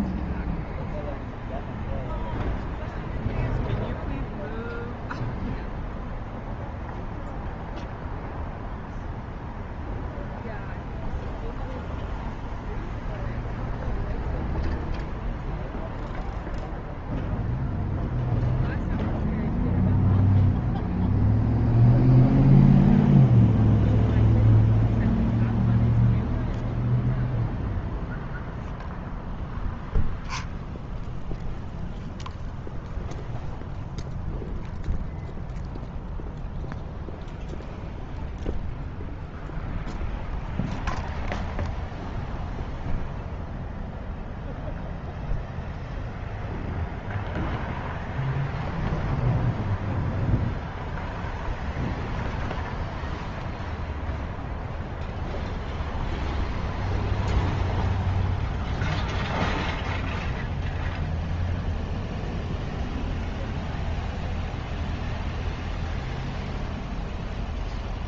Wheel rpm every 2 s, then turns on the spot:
0, 0, 0, 0, 0, 0, 0, 0, 0, 0, 0, 0, 0, 0, 0, 0, 0, 0, 0, 0, 0, 0, 0, 0, 0, 0, 0, 0, 0, 0, 0, 0, 0, 0.
none